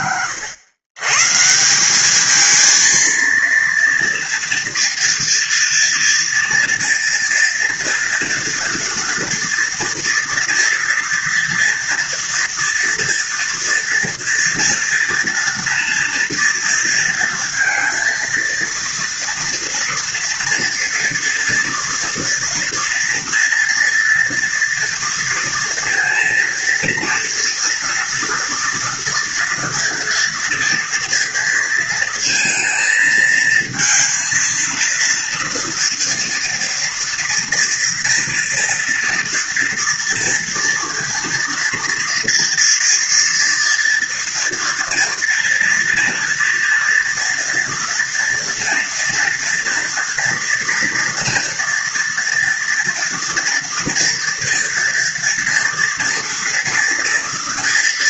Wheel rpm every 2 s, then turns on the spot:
120, 230, 230, 240, 230, 230, 240, 230, 230, 230, 230, 230, 230, 230, 240, 230, 230, 230, 230, 230, 230, 230, 230, 230, 240, 230, 230, 230, 230.
none